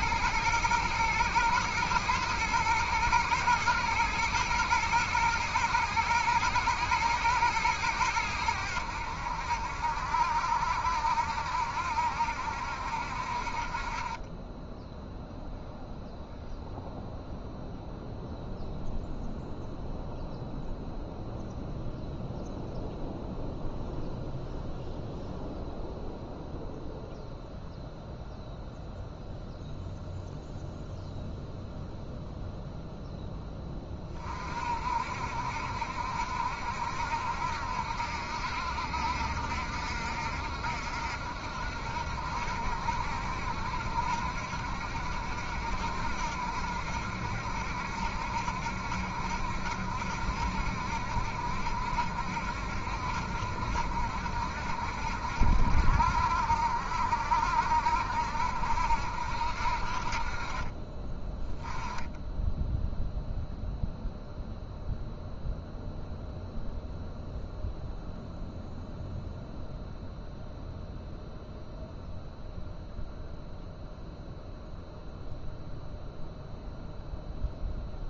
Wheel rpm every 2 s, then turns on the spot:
110, 110, 120, 110, 90, 70, 70, 10, 0, 0, 0, 0, 0, 0, 0, 0, 0, 40, 70, 70, 70, 70, 70, 70, 70, 70, 70, 70, 60, 70, 40, 10, 0, 0, 0, 0, 0, 0, 0.
none